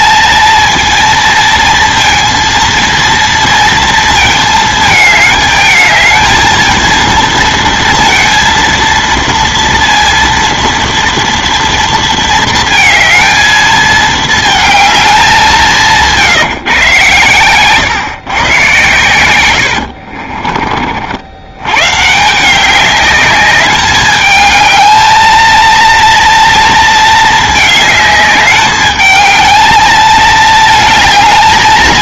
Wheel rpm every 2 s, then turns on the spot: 230, 230, 220, 230, 230, 230, 230, 220, 140, 120, 40, 190, 220, 230, 210, 220.
none